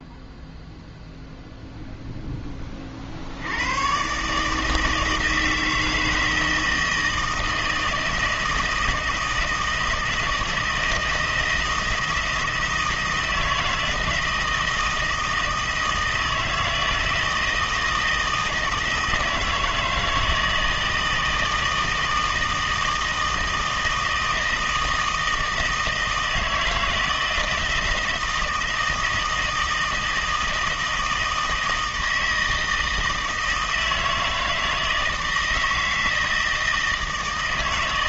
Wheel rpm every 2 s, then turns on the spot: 0, 20, 160, 160, 160, 160, 160, 160, 160, 160, 160, 160, 160, 160, 160, 160, 160, 160, 160.
none